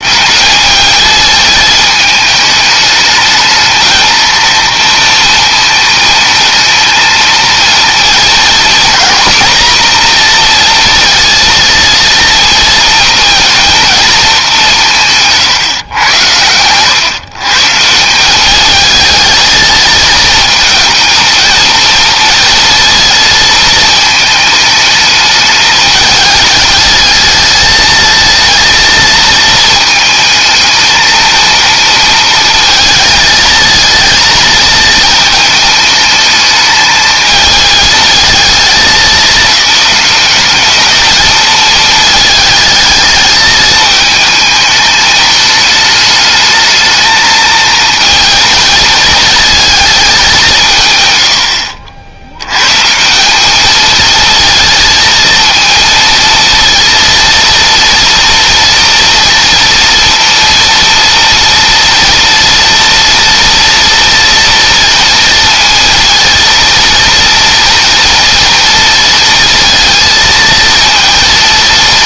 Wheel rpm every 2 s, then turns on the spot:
210, 210, 230, 230, 230, 230, 230, 170, 110, 210, 220, 230, 210, 210, 220, 220, 230, 220, 220, 210, 200, 220, 210, 220, 220, 130, 140, 230, 230, 230, 230, 230, 230, 230, 230, 230.
none